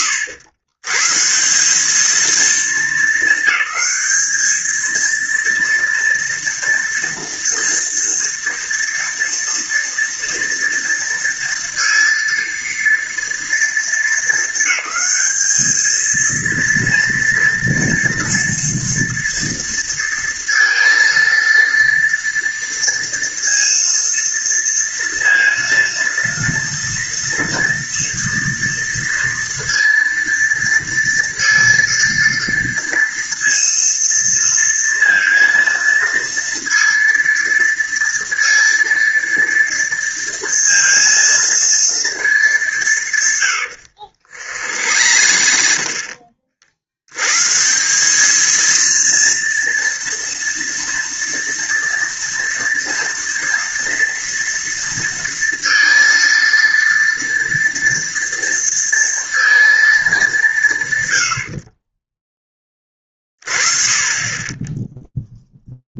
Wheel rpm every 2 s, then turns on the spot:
110, 220, 220, 230, 230, 230, 230, 200, 230, 230, 230, 230, 230, 230, 230, 230, 230, 230, 230, 230, 230, 200, 70, 50, 220, 230, 230, 230, 230, 230, 190, 30, 10.
44-46